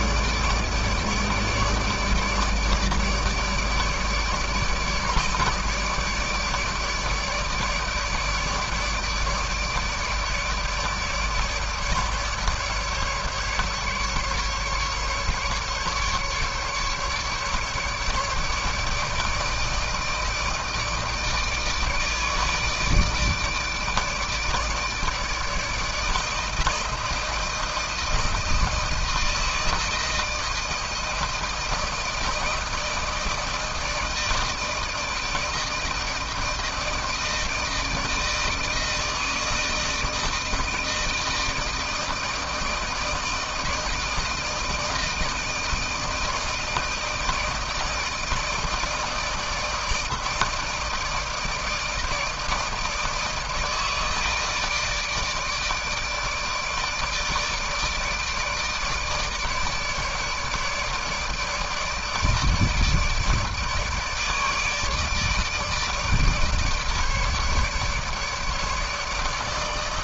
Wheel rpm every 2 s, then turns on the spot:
150, 150, 150, 150, 150, 150, 150, 140, 150, 150, 160, 150, 160, 160, 160, 160, 160, 160, 160, 160, 160, 160, 160, 160, 160, 160, 160, 150, 150, 150, 150, 150, 160, 150, 150.
none